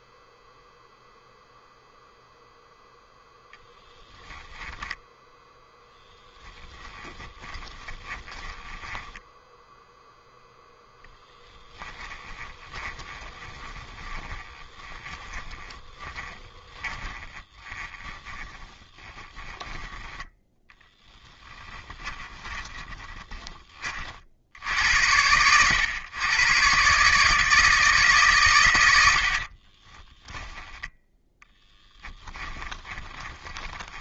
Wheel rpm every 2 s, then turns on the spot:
0, 0, 10, 10, 20, 0, 20, 30, 20, 30, 10, 30, 80, 140, 90, 0, 20.
6-10 12-24 32-34